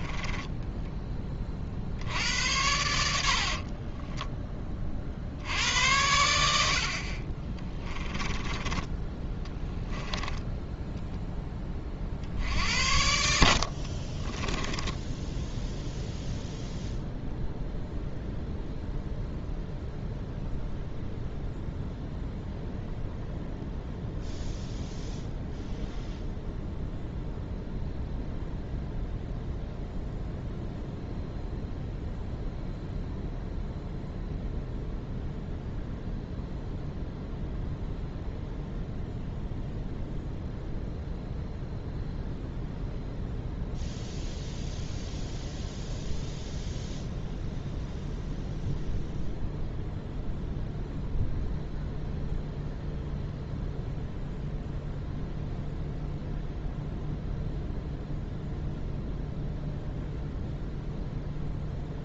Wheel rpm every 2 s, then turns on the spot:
10, 90, 30, 70, 20, 10, 60, 10, 0, 0, 0, 0, 0, 0, 0, 0, 0, 0, 0, 0, 0, 0, 0, 0, 0, 0, 0, 0, 0, 0, 0.
8-12 14-16